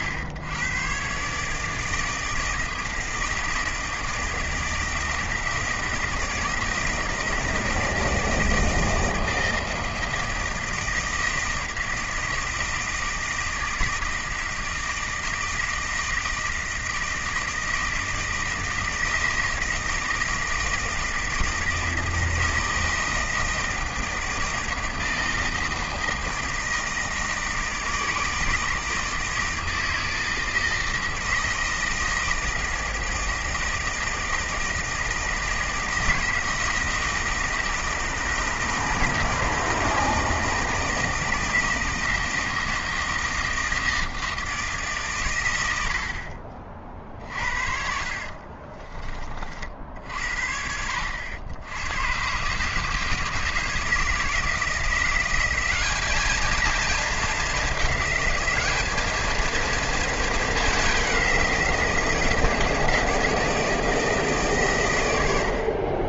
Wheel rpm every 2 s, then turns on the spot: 110, 160, 160, 160, 160, 160, 160, 160, 160, 160, 160, 160, 160, 160, 160, 160, 160, 160, 160, 170, 160, 160, 160, 40, 30, 70, 140, 160, 220, 210, 210, 160, 130.
46-50